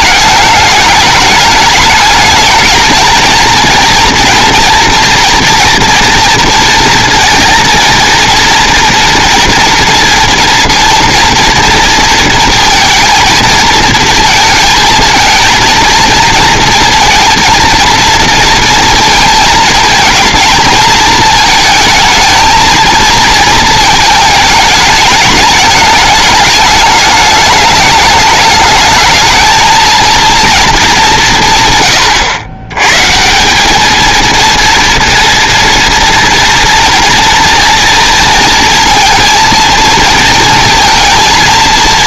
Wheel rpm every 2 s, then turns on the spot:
210, 220, 230, 230, 230, 230, 230, 220, 230, 230, 230, 230, 220, 210, 210, 220, 110, 230, 230, 230, 230.
none